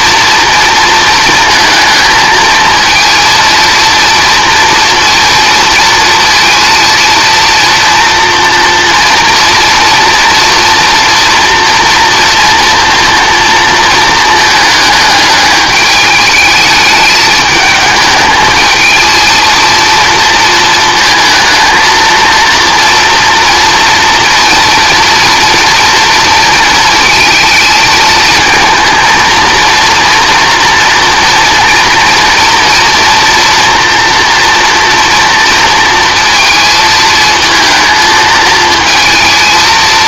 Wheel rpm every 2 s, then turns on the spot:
230, 220, 230, 230, 230, 230, 230, 220, 210, 220, 220, 230, 230, 230, 230, 230, 240, 230, 220, 230.
none